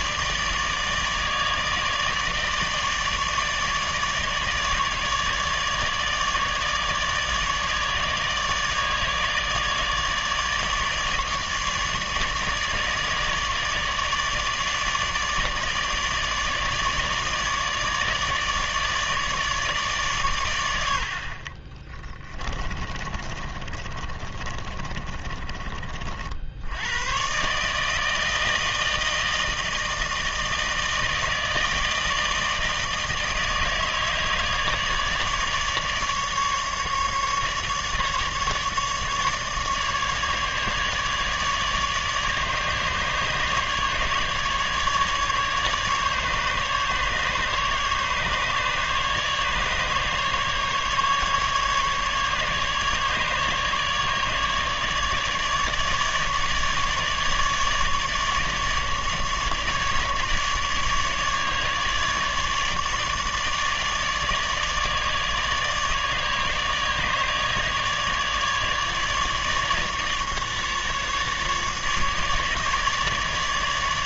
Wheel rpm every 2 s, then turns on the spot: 150, 150, 150, 150, 150, 150, 150, 150, 150, 150, 90, 30, 30, 80, 160, 160, 160, 150, 150, 150, 150, 150, 150, 150, 150, 150, 150, 150, 150, 150, 150, 150, 150, 150, 150, 150, 150.
22-26